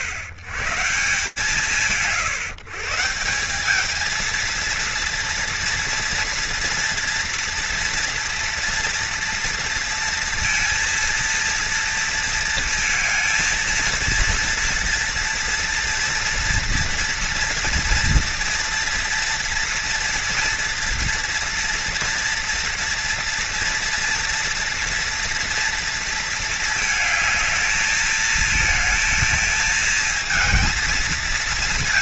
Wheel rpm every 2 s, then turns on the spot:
130, 130, 230, 230, 230, 230, 230, 230, 230, 240, 230, 230, 230, 230, 220, 220.
none